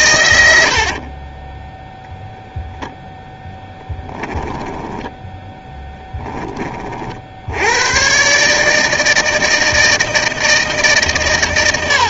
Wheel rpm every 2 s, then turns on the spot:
70, 0, 10, 30, 160, 150.
0-2 4-6